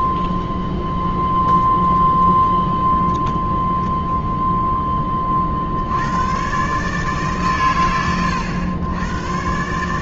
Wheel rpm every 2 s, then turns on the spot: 0, 10, 0, 100, 80.
2-4